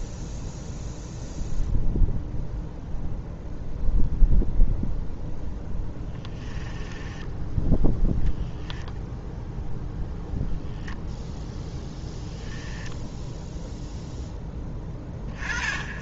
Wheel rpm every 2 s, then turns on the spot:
0, 0, 0, 10, 0, 0, 10, 10.
6-8 12-14